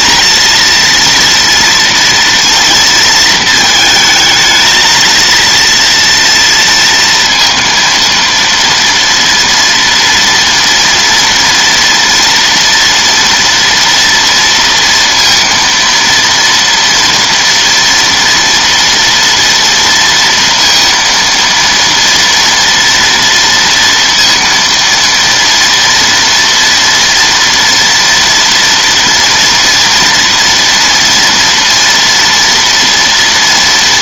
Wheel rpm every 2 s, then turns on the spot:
230, 220, 230, 230, 230, 230, 230, 230, 230, 230, 230, 230, 230, 230, 230, 230, 230.
none